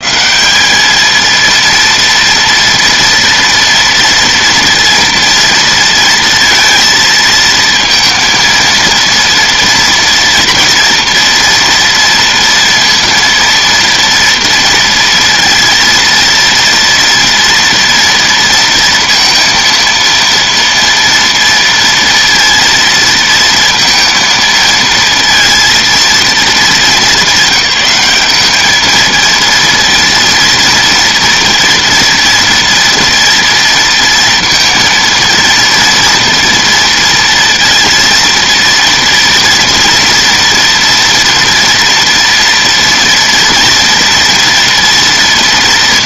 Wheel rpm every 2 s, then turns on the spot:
210, 230, 230, 230, 230, 230, 230, 230, 230, 230, 230, 230, 230, 190, 220, 230, 230, 230, 230, 230, 230, 230, 230.
none